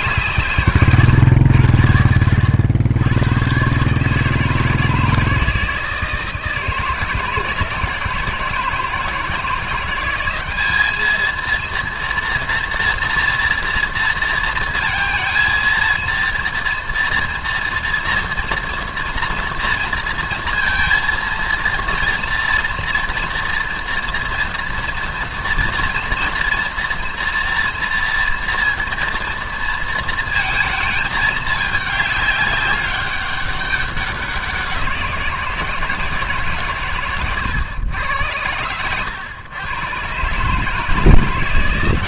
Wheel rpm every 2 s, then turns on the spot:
140, 80, 160, 160, 160, 200, 240, 230, 230, 240, 230, 230, 240, 230, 230, 230, 200, 180, 140, 100, 150.
none